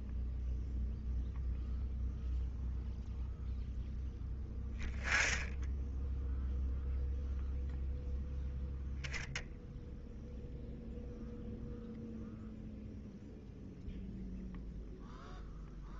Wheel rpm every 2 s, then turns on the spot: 0, 0, 10, 0, 0, 0, 0, 0.
none